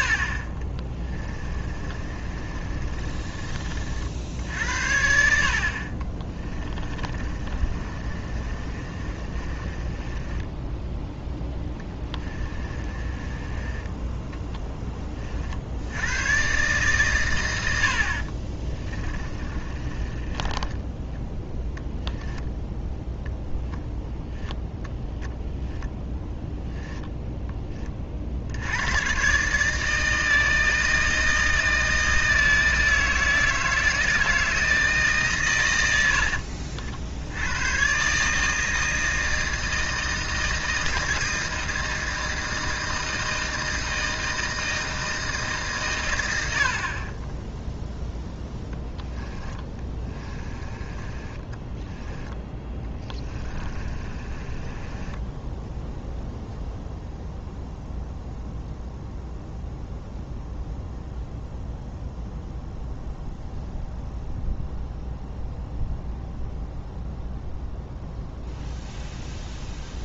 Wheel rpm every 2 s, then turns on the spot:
40, 30, 70, 30, 30, 10, 20, 10, 130, 30, 10, 0, 10, 10, 80, 160, 160, 160, 60, 160, 160, 160, 160, 50, 10, 20, 10, 20, 0, 0, 0, 0, 0, 0, 0.
0-4 6-14 18-22 26-28 48-56